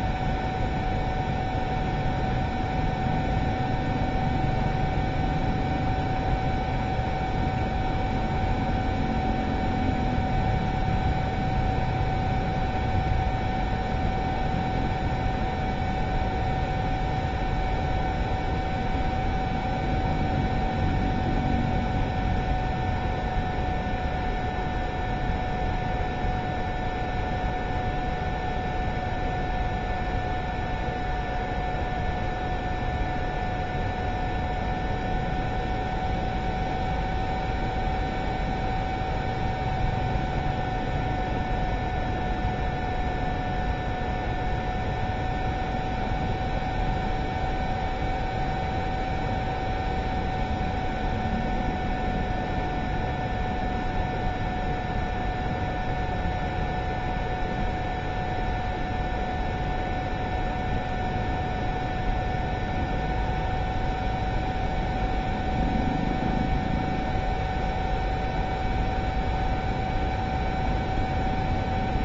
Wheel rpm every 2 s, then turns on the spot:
0, 0, 0, 0, 0, 0, 0, 0, 0, 0, 0, 0, 0, 0, 0, 0, 0, 0, 0, 0, 0, 0, 0, 0, 0, 0, 0, 0, 0, 0, 0, 0, 0, 0, 0, 0.
none